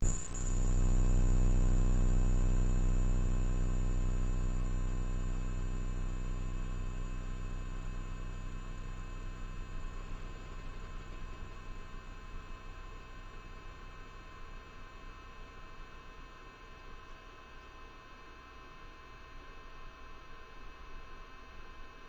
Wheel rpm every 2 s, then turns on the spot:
0, 0, 0, 0, 0, 0, 0, 0, 0, 0, 0.
none